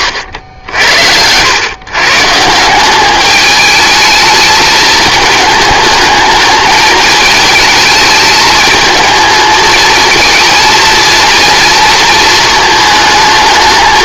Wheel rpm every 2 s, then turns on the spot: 90, 170, 220, 210, 220, 230, 220.
none